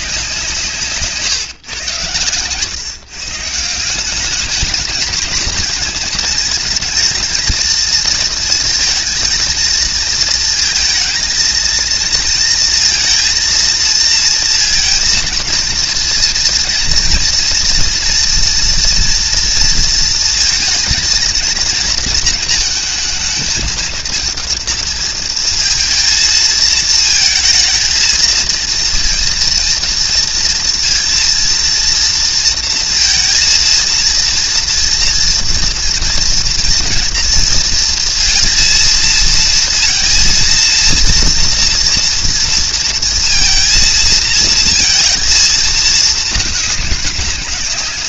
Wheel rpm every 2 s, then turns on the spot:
160, 120, 210, 230, 230, 230, 230, 230, 230, 230, 230, 220, 230, 220, 230, 230, 230, 230, 240, 230, 230, 230, 230, 200.
none